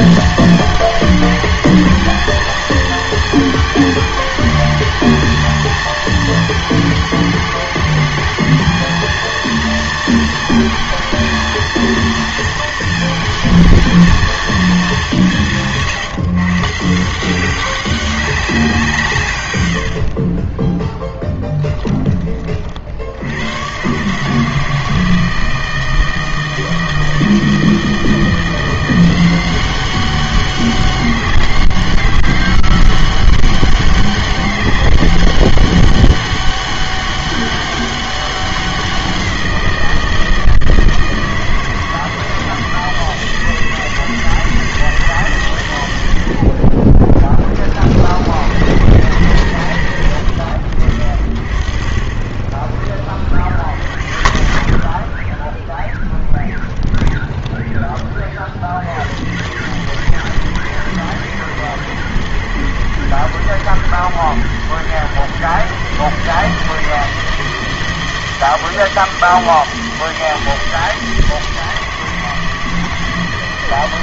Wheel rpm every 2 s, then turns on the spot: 220, 230, 220, 220, 220, 230, 230, 210, 150, 180, 10, 50, 160, 160, 170, 200, 200, 200, 200, 190, 160, 160, 160, 30, 70, 50, 20, 0, 10, 50, 110, 110, 120, 150, 160, 160, 160.
20-22 46-48